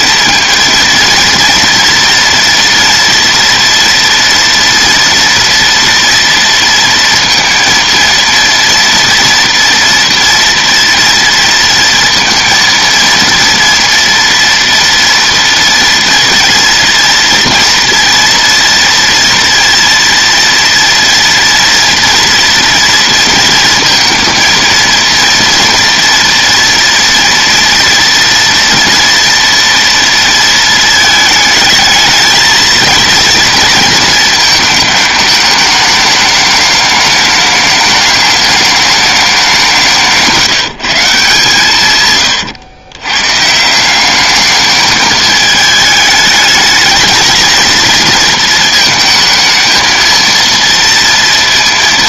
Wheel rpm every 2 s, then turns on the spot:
230, 230, 230, 230, 230, 230, 230, 230, 230, 230, 230, 230, 230, 230, 240, 220, 230, 210, 210, 210, 160, 120, 220, 220, 220, 230.
none